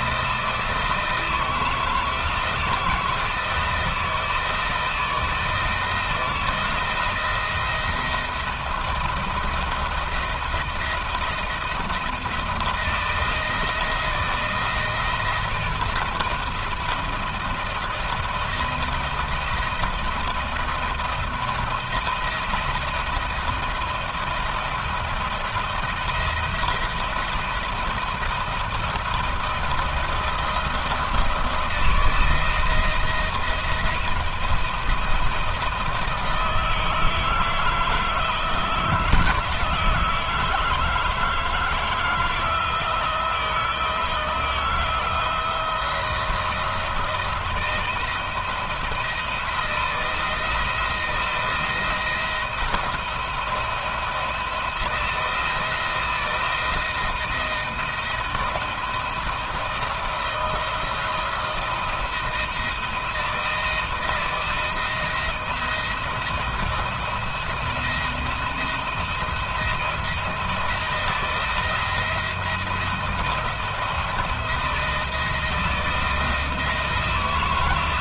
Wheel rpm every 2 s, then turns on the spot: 160, 160, 170, 170, 170, 170, 170, 160, 160, 170, 160, 170, 160, 170, 170, 170, 160, 170, 160, 160, 160, 160, 170, 160, 170, 170, 170, 170, 170, 170, 170, 160, 160, 160, 170, 170, 170, 170, 160.
none